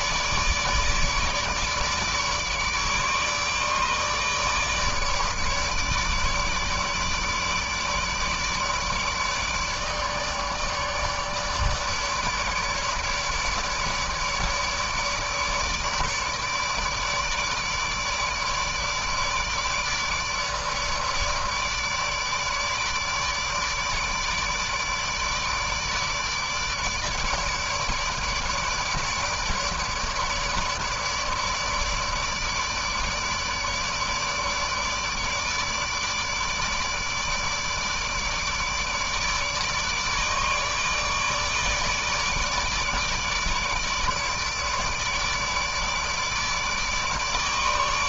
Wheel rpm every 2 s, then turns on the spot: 150, 150, 150, 150, 150, 150, 150, 150, 150, 150, 150, 150, 150, 150, 160, 150, 150, 150, 150, 150, 150, 150, 150, 150.
none